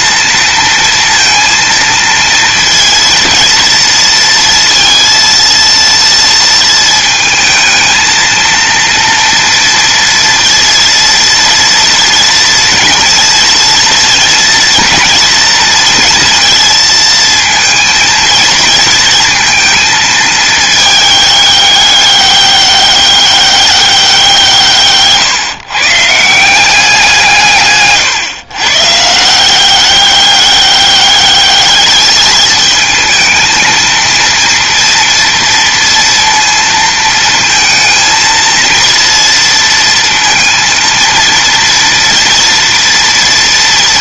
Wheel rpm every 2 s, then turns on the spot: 230, 230, 230, 220, 230, 230, 230, 230, 230, 230, 210, 200, 140, 170, 160, 200, 220, 230, 230, 230, 230, 230.
none